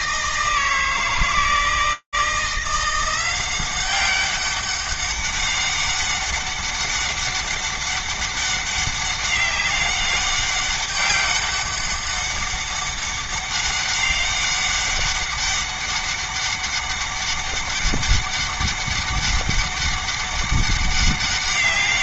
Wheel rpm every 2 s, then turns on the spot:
160, 180, 200, 200, 200, 200, 200, 200, 200, 200, 200.
none